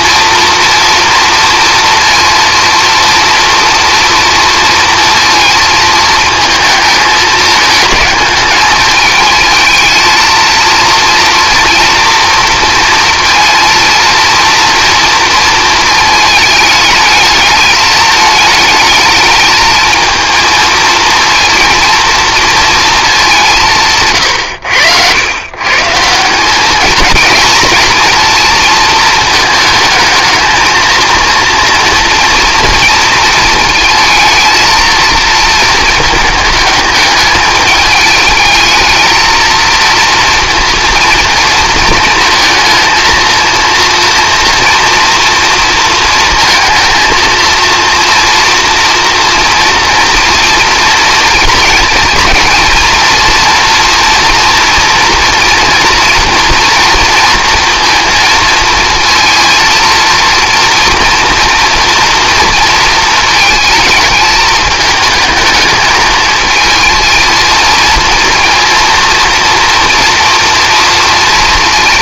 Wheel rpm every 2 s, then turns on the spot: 240, 230, 230, 220, 210, 230, 230, 230, 220, 210, 220, 230, 100, 200, 230, 220, 230, 230, 210, 220, 230, 230, 230, 230, 240, 230, 230, 240, 230, 220, 230, 230, 220, 230, 230, 230.
none